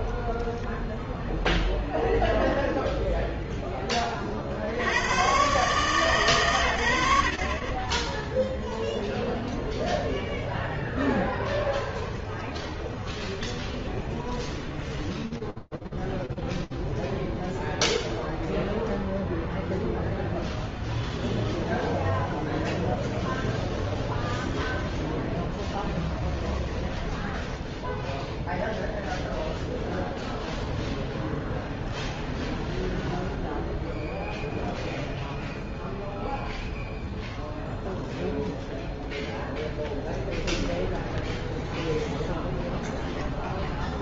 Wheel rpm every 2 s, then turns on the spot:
10, 0, 60, 100, 0, 0, 20, 10, 0, 0, 0, 0, 10, 10, 0, 10, 0, 0, 0, 0, 0, 0.
12-16 26-28 30-32